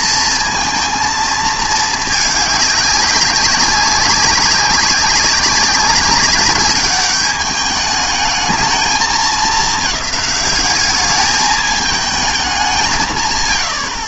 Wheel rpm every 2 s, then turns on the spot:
230, 200, 200, 200, 220, 200, 210.
none